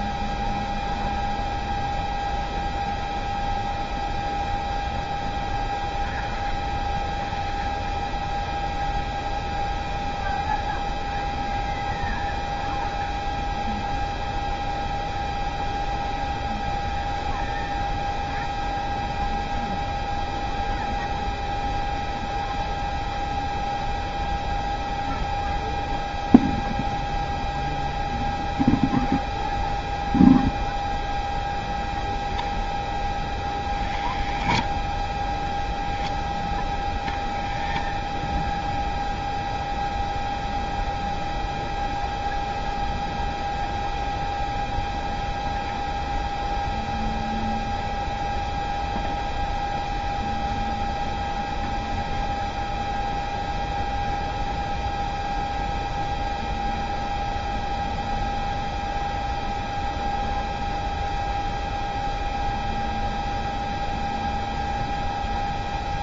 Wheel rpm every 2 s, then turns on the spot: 0, 0, 0, 0, 0, 0, 0, 0, 0, 0, 0, 0, 0, 0, 0, 0, 0, 0, 0, 0, 0, 0, 0, 0, 0, 0, 0, 0, 0, 0, 0, 0, 0.
none